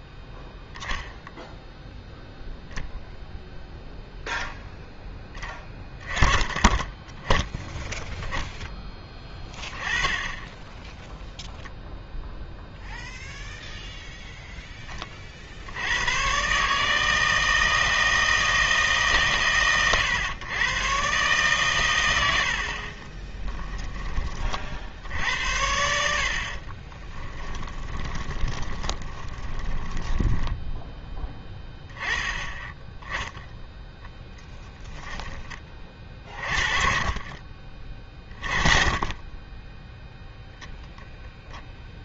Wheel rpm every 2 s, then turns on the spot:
0, 0, 10, 20, 10, 10, 0, 10, 140, 160, 120, 60, 50, 30, 20, 10, 10, 10, 40, 20, 0.
26-30